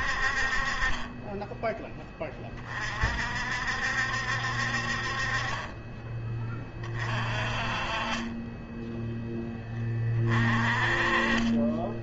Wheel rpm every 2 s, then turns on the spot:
30, 40, 50, 30, 10, 30.
none